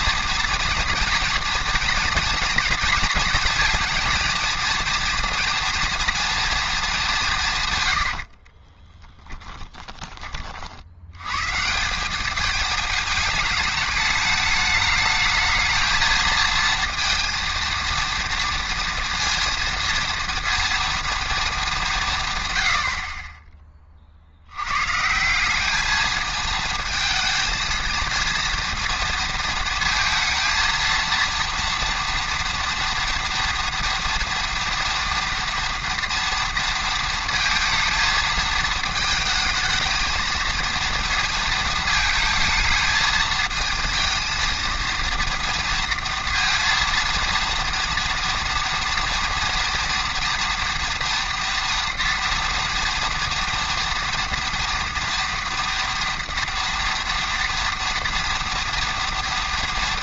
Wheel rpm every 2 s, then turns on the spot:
230, 220, 230, 220, 30, 50, 210, 210, 230, 230, 230, 110, 110, 220, 230, 230, 230, 230, 230, 220, 230, 220, 230, 230, 230, 230, 230, 230, 230, 230.
8-10